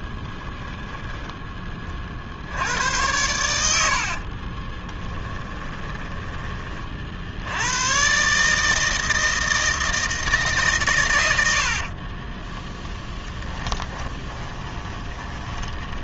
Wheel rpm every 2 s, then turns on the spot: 10, 90, 20, 40, 160, 130, 10, 20.
0-2 4-6 12-16